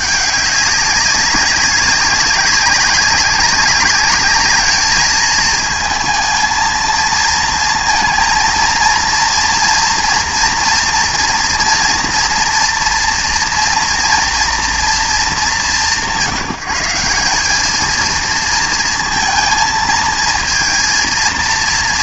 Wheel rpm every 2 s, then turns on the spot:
200, 200, 210, 220, 230, 230, 240, 230, 180, 230, 230.
none